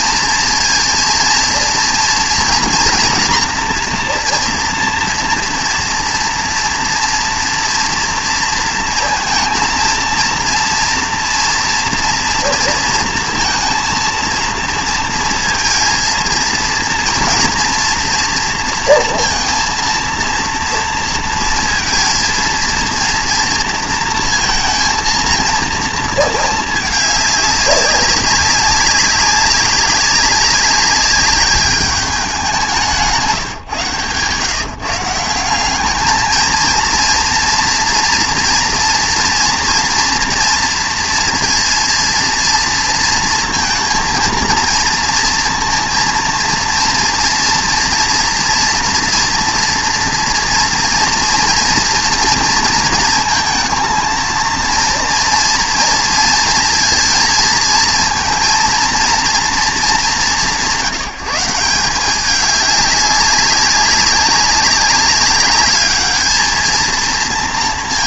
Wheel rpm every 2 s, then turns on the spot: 230, 230, 230, 230, 230, 230, 230, 230, 230, 230, 230, 230, 230, 210, 190, 200, 180, 150, 230, 230, 230, 230, 230, 230, 230, 230, 230, 230, 230, 230, 160, 200, 200, 230.
none